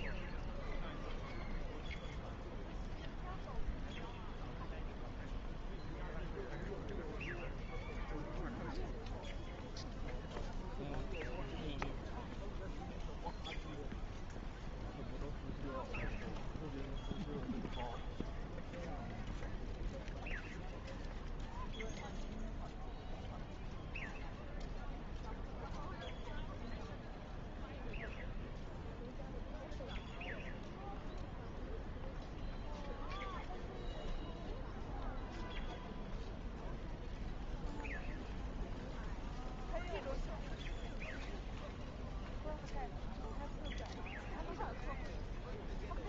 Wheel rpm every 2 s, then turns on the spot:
0, 0, 0, 0, 0, 0, 0, 0, 0, 0, 0, 0, 0, 0, 0, 0, 0, 0, 0, 0, 0, 0, 0.
none